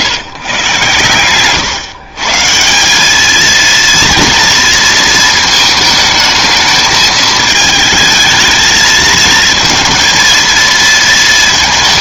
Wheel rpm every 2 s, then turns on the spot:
130, 170, 230, 220, 220, 230.
none